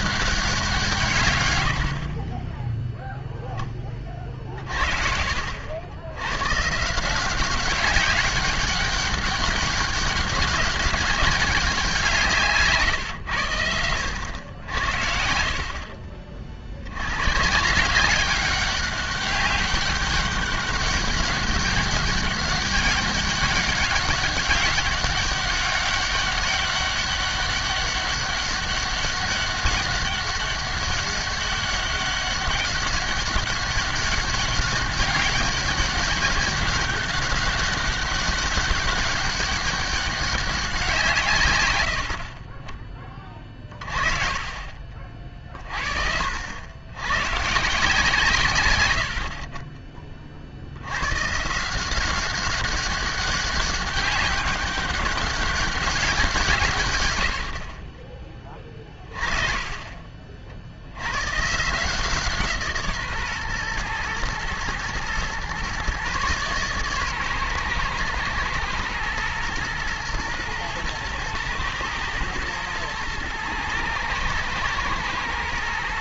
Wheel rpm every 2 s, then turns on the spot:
200, 20, 40, 120, 190, 200, 160, 80, 50, 200, 200, 200, 200, 200, 200, 200, 200, 200, 200, 200, 200, 30, 40, 70, 130, 50, 190, 200, 190, 20, 50, 160, 110, 130, 120, 110, 110, 110.
2-4